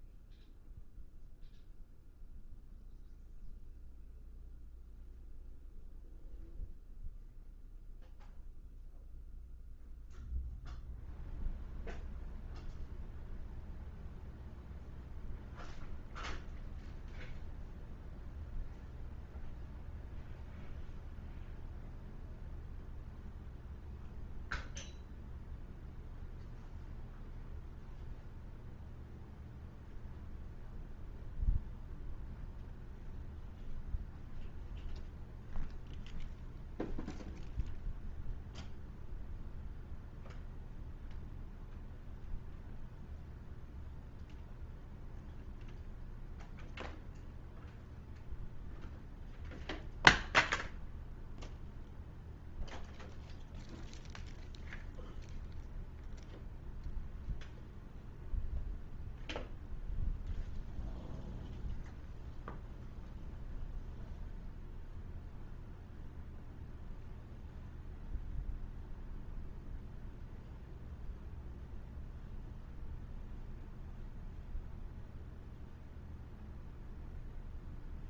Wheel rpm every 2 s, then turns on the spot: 0, 0, 0, 0, 0, 0, 0, 0, 0, 0, 0, 0, 0, 0, 0, 0, 0, 0, 0, 0, 0, 0, 0, 0, 0, 0, 0, 0, 0, 0, 0, 0, 0, 0, 0, 0, 0, 0, 0.
none